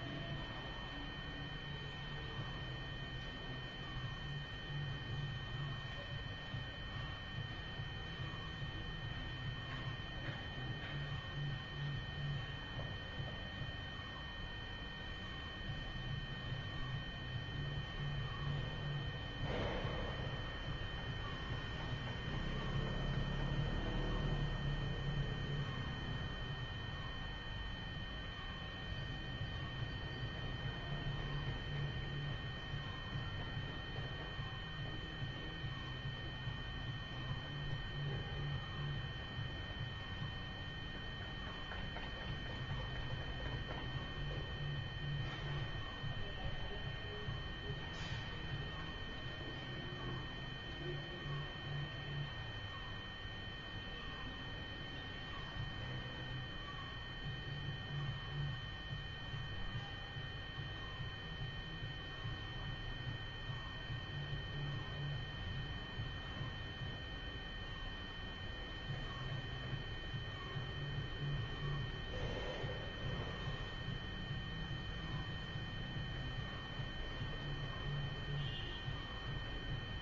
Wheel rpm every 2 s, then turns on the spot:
0, 0, 0, 0, 0, 0, 0, 0, 0, 0, 0, 0, 0, 0, 0, 0, 0, 0, 0, 0, 0, 0, 0, 0, 0, 0, 0, 0, 0, 0, 0, 0, 0, 0, 0, 0, 0, 0, 0, 0.
none